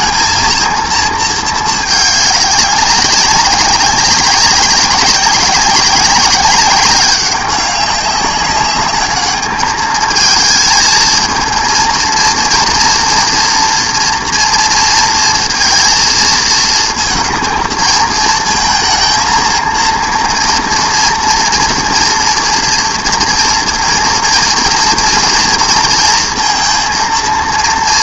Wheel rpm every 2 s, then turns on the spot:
230, 190, 190, 200, 210, 220, 230, 230, 230, 220, 230, 230, 230, 230.
none